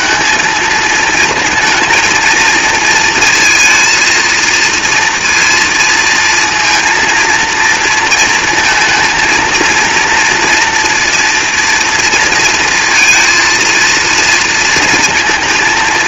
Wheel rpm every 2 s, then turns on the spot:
220, 230, 230, 230, 230, 240, 230, 230.
none